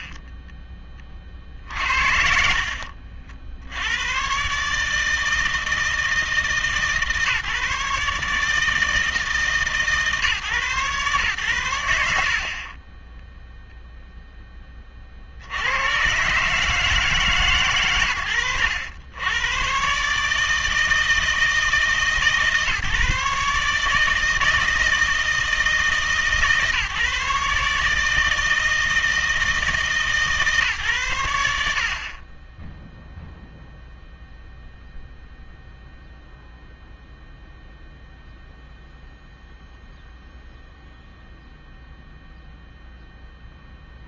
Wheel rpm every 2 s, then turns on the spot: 20, 60, 150, 140, 160, 140, 50, 20, 150, 90, 160, 150, 160, 150, 160, 130, 0, 0, 0, 0, 0, 0.
none